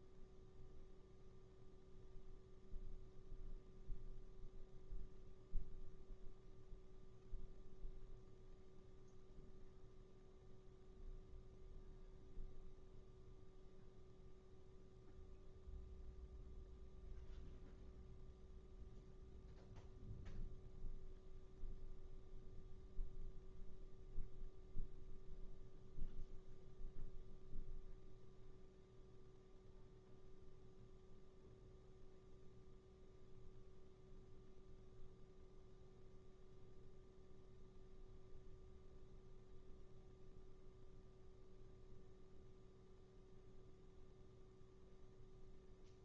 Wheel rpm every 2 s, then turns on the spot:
0, 0, 0, 0, 0, 0, 0, 0, 0, 0, 0, 0, 0, 0, 0, 0, 0, 0, 0, 0, 0, 0, 0.
none